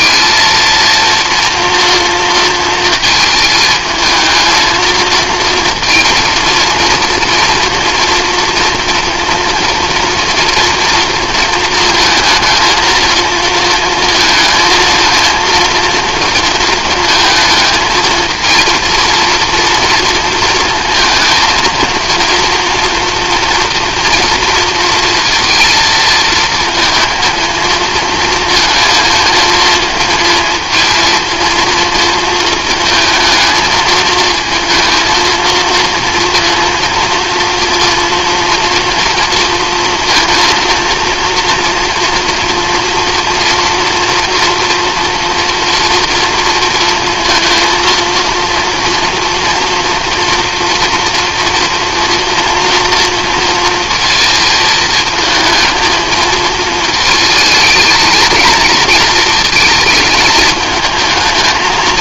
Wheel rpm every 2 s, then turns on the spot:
230, 220, 220, 230, 230, 230, 230, 230, 230, 230, 230, 230, 230, 230, 220, 220, 230, 230, 230, 230, 230, 230, 230, 230, 240, 230, 230, 220, 220, 230, 220.
none